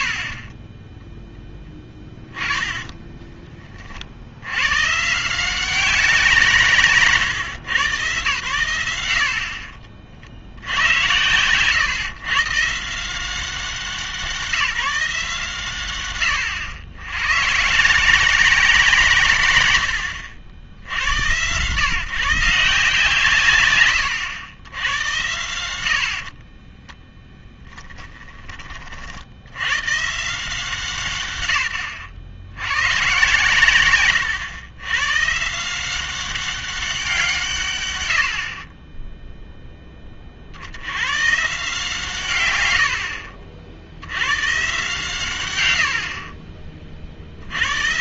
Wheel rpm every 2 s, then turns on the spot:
40, 20, 120, 160, 110, 80, 140, 170, 110, 180, 70, 150, 90, 20, 40, 170, 110, 110, 190, 50, 60, 100, 130, 40.
0-4 26-28